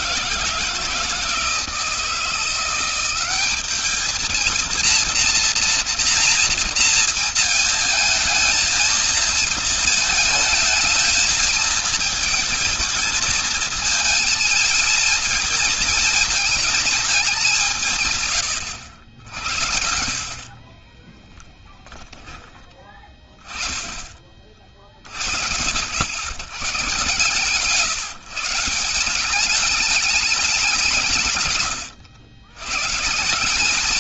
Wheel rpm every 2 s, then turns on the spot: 160, 180, 230, 230, 220, 220, 220, 220, 220, 90, 40, 30, 40, 110, 170, 180, 140.
20-22